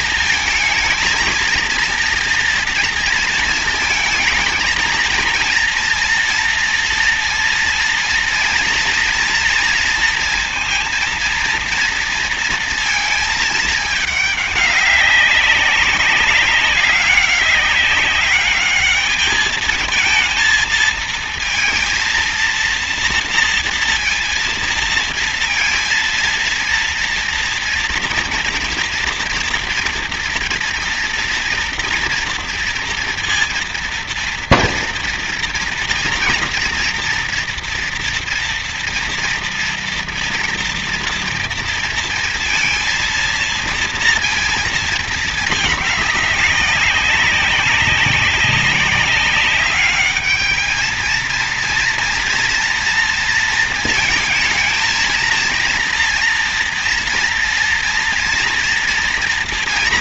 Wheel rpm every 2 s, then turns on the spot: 230, 230, 230, 230, 230, 230, 230, 200, 200, 210, 230, 230, 230, 230, 230, 230, 230, 230, 230, 230, 240, 230, 230, 200, 200, 220, 230, 230, 230, 240.
none